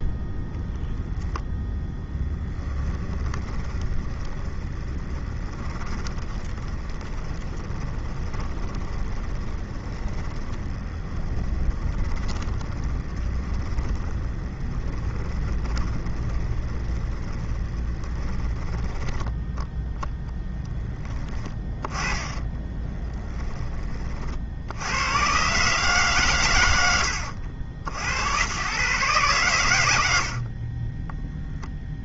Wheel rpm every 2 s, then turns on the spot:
0, 10, 20, 20, 20, 20, 20, 10, 20, 10, 10, 10, 80, 100, 110, 20.
2-20 22-24